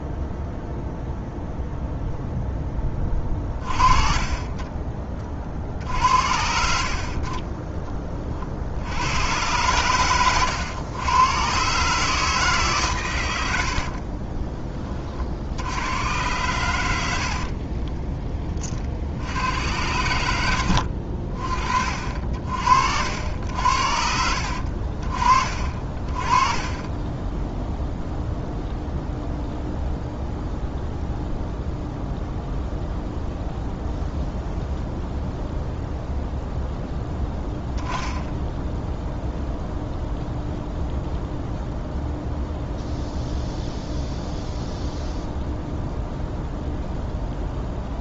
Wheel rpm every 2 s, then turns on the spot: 0, 10, 20, 60, 50, 110, 140, 30, 100, 20, 90, 60, 60, 20, 0, 0, 0, 0, 0, 0, 0, 0, 0, 0.
none